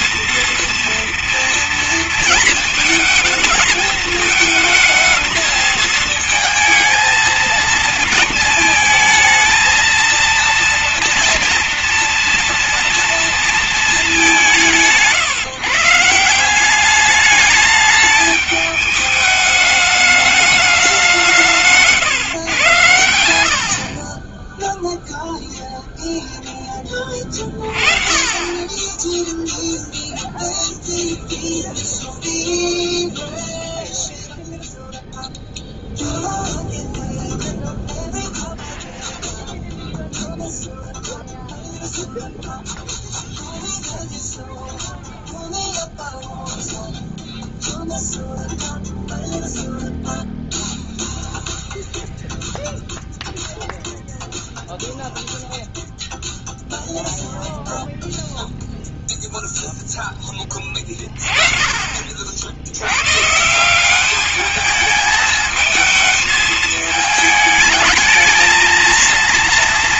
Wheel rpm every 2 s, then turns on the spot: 230, 220, 230, 230, 220, 230, 230, 150, 210, 210, 170, 70, 0, 30, 10, 0, 0, 0, 0, 0, 0, 0, 0, 0, 0, 0, 0, 0, 0, 0, 20, 90, 210, 220, 220.
none